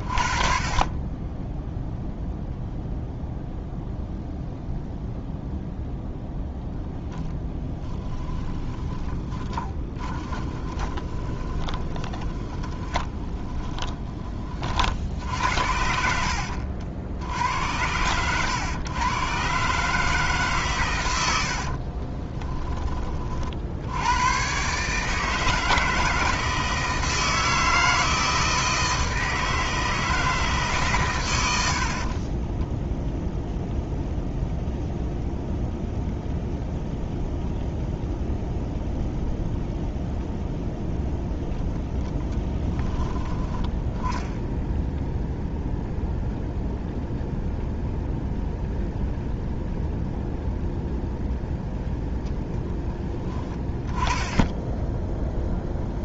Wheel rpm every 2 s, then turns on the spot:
40, 0, 0, 0, 10, 20, 20, 50, 60, 110, 120, 20, 150, 160, 160, 140, 0, 0, 0, 0, 0, 10, 0, 0, 0, 0, 10, 10.
8-14